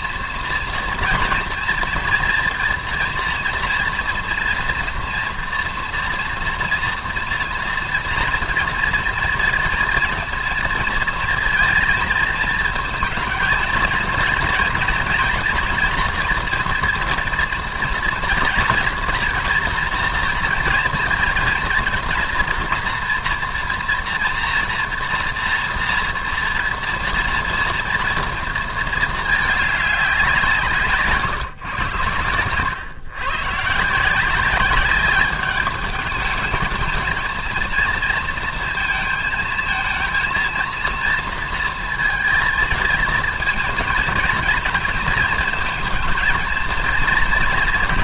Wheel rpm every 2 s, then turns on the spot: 240, 230, 230, 230, 230, 230, 220, 230, 230, 230, 230, 240, 240, 230, 230, 160, 130, 190, 220, 220, 230, 230, 230, 230.
none